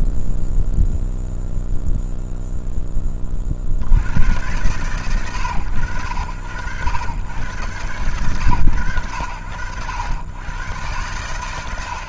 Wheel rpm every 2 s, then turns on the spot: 0, 10, 100, 90, 110, 90.
none